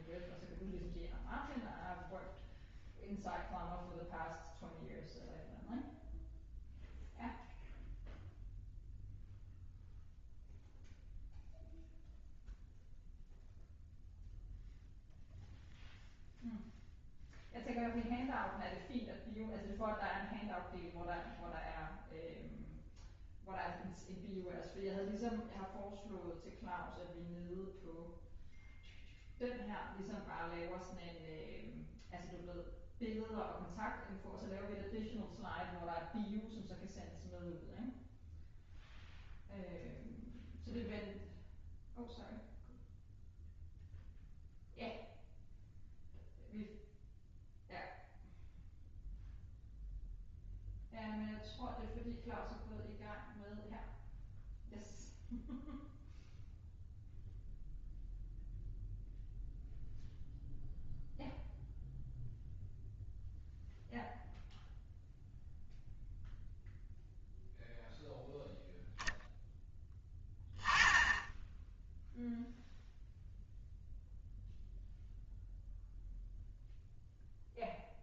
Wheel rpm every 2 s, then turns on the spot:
0, 0, 0, 0, 0, 0, 0, 0, 0, 0, 0, 0, 0, 0, 0, 0, 0, 0, 0, 0, 0, 0, 0, 0, 0, 0, 0, 0, 0, 0, 0, 0, 0, 0, 0, 10, 0, 0, 0.
none